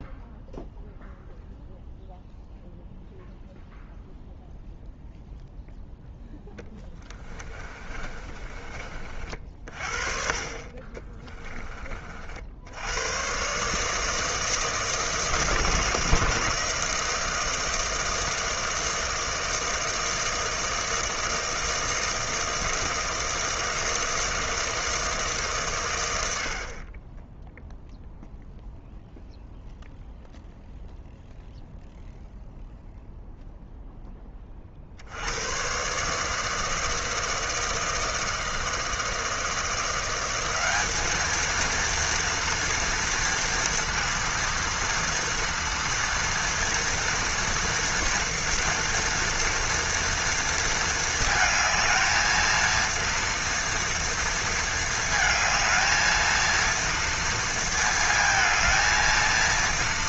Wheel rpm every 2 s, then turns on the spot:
0, 0, 0, 10, 40, 30, 90, 160, 160, 160, 160, 160, 160, 40, 0, 0, 0, 60, 160, 160, 210, 230, 230, 230, 230, 220, 230, 220, 230, 230.
6-8